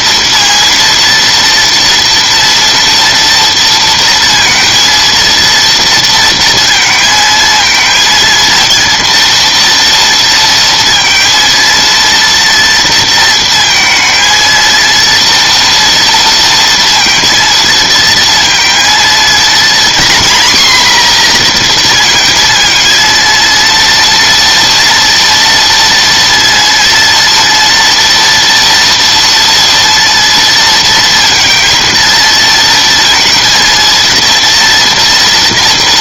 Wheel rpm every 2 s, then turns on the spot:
230, 230, 230, 230, 230, 230, 230, 230, 230, 230, 250, 230, 230, 230, 230, 230, 230, 230.
none